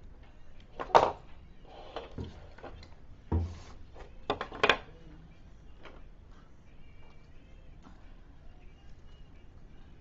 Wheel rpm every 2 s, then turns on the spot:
0, 0, 0, 0, 0.
none